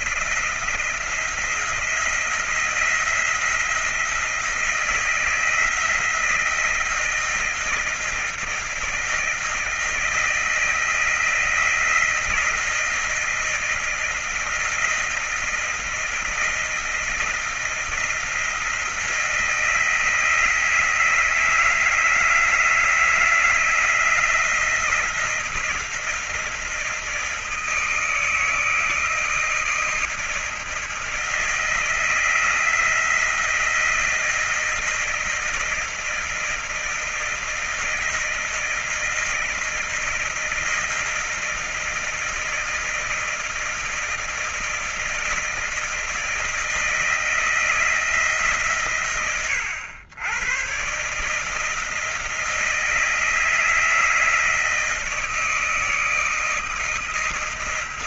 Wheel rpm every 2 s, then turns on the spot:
170, 170, 170, 170, 160, 160, 160, 160, 160, 170, 160, 160, 170, 170, 160, 160, 160, 160, 160, 160, 160, 160, 160, 160, 120, 120, 160, 160, 160.
none